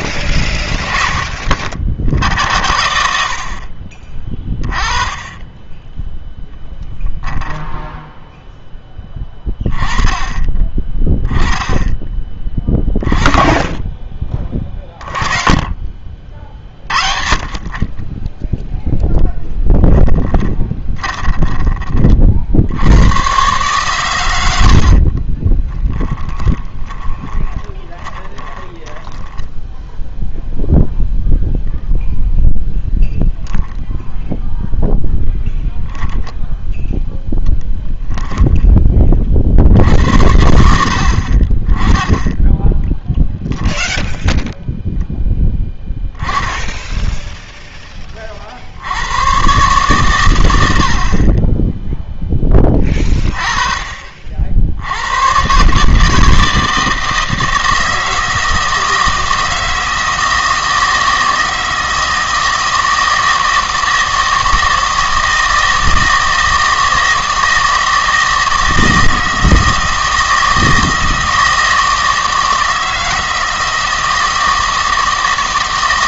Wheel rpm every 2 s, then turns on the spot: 30, 80, 20, 0, 10, 20, 20, 30, 50, 0, 10, 70, 70, 20, 10, 0, 0, 0, 0, 20, 60, 10, 0, 10, 70, 70, 20, 70, 160, 160, 160, 160, 160, 160, 160, 160, 160, 160.
20-22 24-30